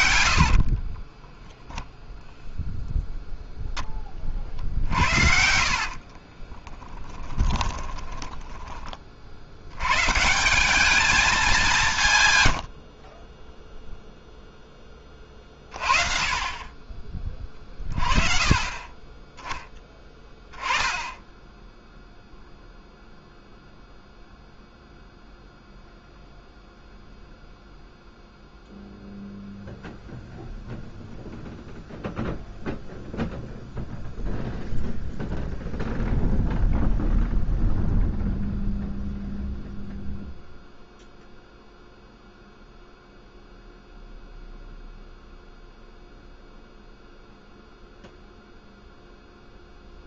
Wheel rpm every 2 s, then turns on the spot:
40, 0, 60, 10, 30, 200, 50, 20, 30, 20, 10, 0, 0, 0, 0, 0, 0, 0, 0, 0, 0, 0, 0, 0, 0.
0-2 4-8 12-14